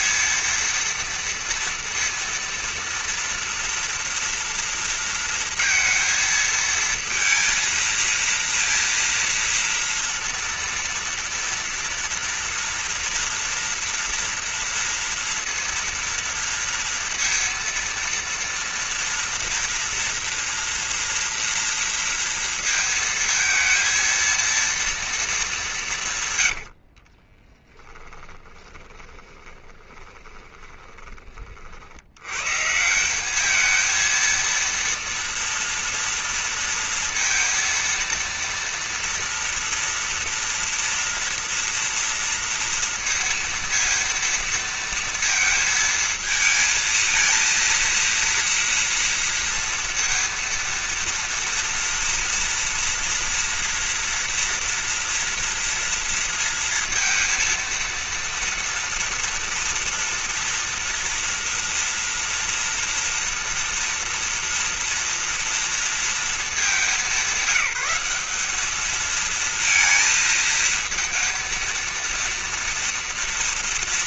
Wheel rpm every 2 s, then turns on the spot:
230, 230, 230, 230, 230, 230, 230, 230, 230, 230, 240, 230, 230, 110, 20, 20, 110, 230, 230, 230, 230, 230, 230, 220, 230, 230, 230, 230, 230, 230, 230, 230, 230, 210, 210, 230, 230.
26-32